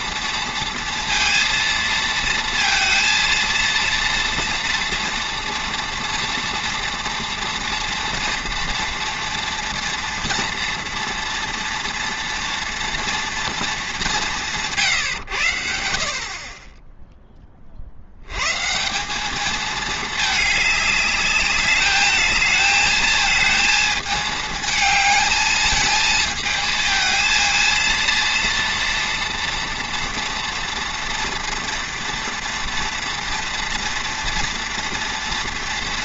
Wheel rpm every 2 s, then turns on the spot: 230, 230, 230, 230, 230, 230, 230, 160, 30, 130, 210, 220, 220, 220, 230, 230, 230, 240.
none